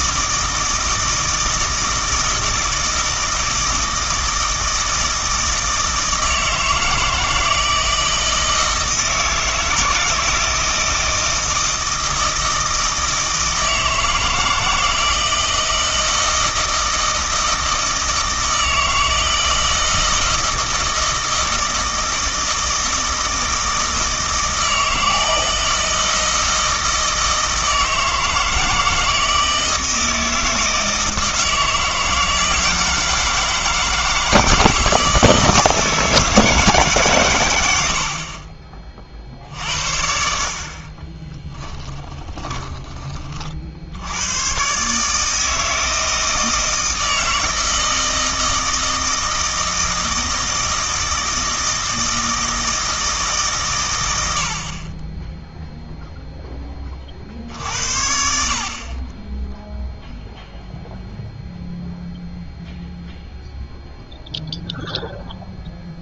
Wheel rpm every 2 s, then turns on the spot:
160, 160, 160, 160, 160, 160, 160, 160, 160, 160, 160, 160, 160, 160, 160, 160, 160, 160, 150, 30, 50, 20, 120, 160, 160, 160, 160, 60, 10, 50, 0, 0, 0.
42-44